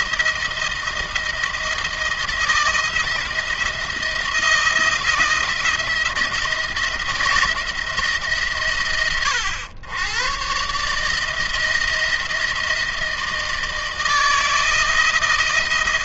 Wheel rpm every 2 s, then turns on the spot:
170, 170, 170, 170, 130, 140, 160, 160.
none